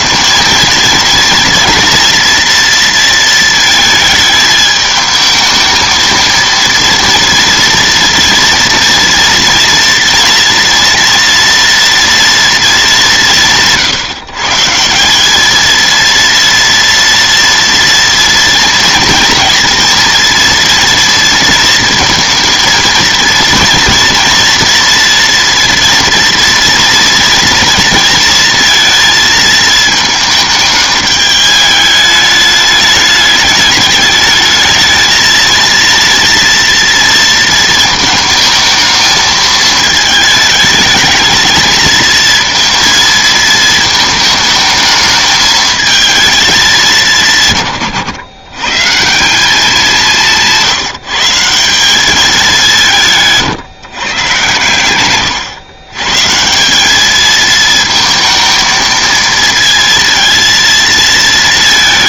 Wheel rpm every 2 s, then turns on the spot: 230, 230, 220, 230, 230, 230, 200, 160, 230, 230, 230, 230, 230, 230, 220, 210, 210, 220, 230, 220, 220, 230, 220, 200, 120, 170, 190, 120, 190, 220, 230.
none